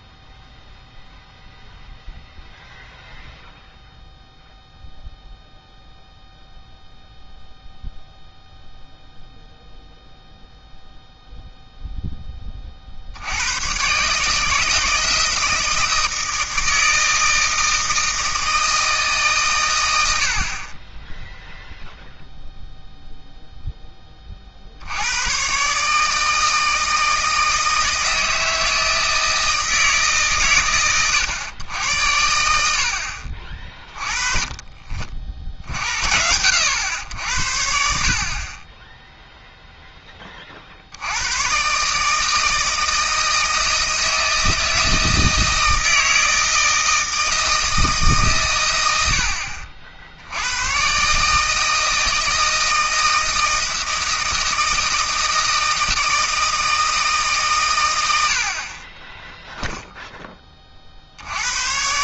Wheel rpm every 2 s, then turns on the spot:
0, 0, 0, 0, 0, 0, 20, 150, 160, 160, 40, 0, 60, 160, 160, 130, 70, 40, 90, 30, 50, 160, 160, 160, 120, 100, 160, 160, 160, 50, 30.
none